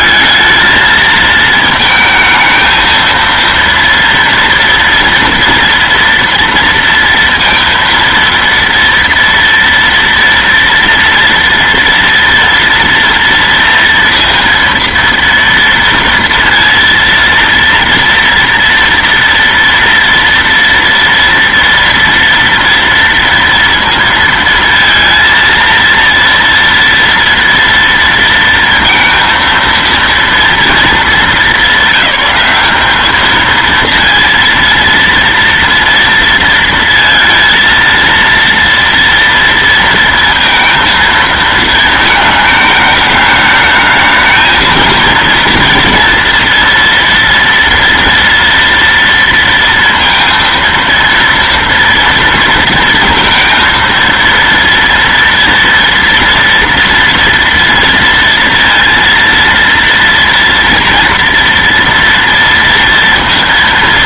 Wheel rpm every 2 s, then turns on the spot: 220, 220, 230, 230, 230, 230, 230, 230, 230, 230, 230, 230, 230, 230, 230, 230, 200, 230, 230, 230, 230, 220, 220, 230, 240, 230, 230, 230, 230, 230, 230, 230.
none